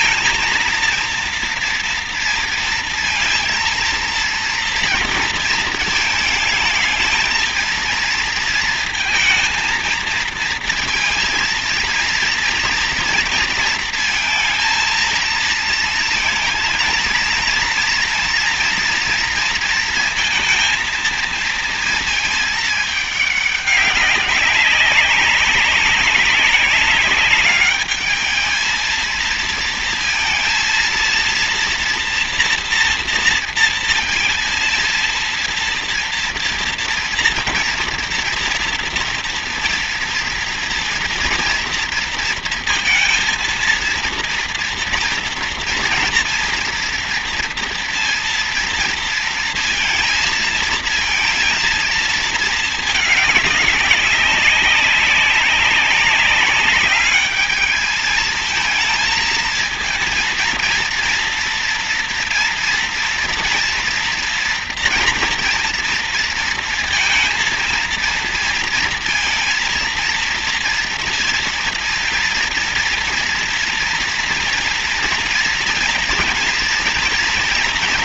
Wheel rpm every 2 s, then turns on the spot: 230, 230, 230, 220, 230, 230, 230, 230, 230, 230, 230, 210, 200, 200, 220, 230, 230, 230, 230, 230, 230, 230, 230, 230, 230, 230, 220, 200, 200, 220, 230, 230, 230, 230, 230, 230, 230, 230, 230.
none